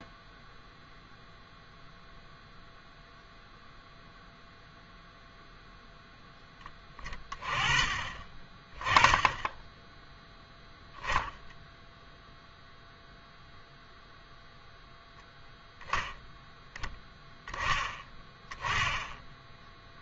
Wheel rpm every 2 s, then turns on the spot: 0, 0, 0, 10, 30, 0, 0, 0, 10, 10.
none